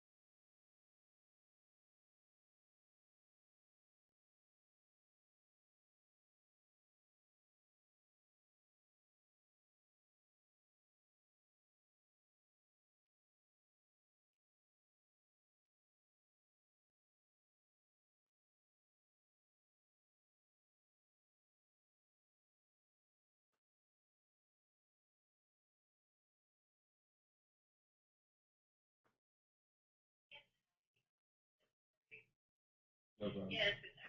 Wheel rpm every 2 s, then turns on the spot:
0, 0, 0, 0, 0, 0, 0, 0, 0, 0, 0, 0, 0, 0, 0, 0, 0.
none